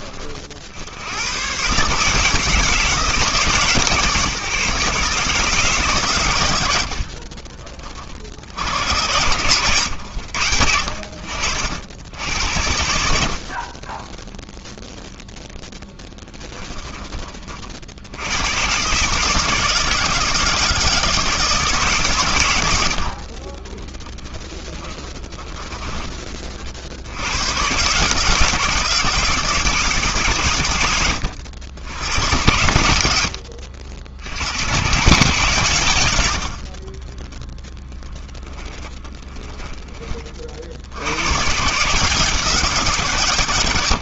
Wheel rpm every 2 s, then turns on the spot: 60, 160, 140, 70, 70, 70, 70, 0, 10, 110, 170, 90, 10, 50, 160, 110, 100, 110, 50, 20, 70, 170.
6-8 24-26 36-40